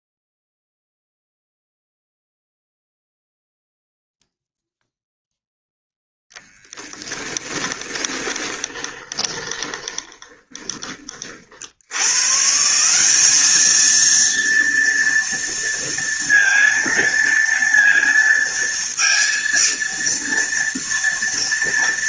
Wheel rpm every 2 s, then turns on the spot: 0, 0, 0, 10, 20, 30, 150, 230, 230, 230, 230.
8-12